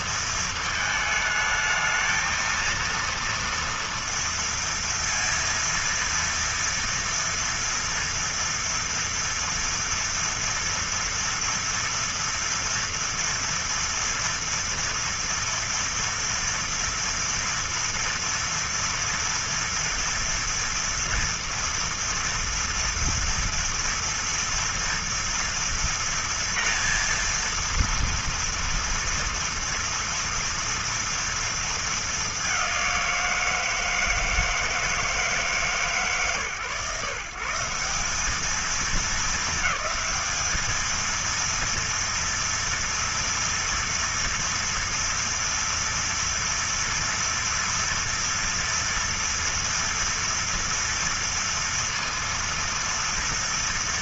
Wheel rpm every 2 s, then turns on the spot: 220, 230, 230, 230, 230, 230, 230, 240, 230, 230, 230, 230, 230, 230, 230, 230, 180, 160, 140, 220, 220, 230, 230, 230, 240, 230, 230.
none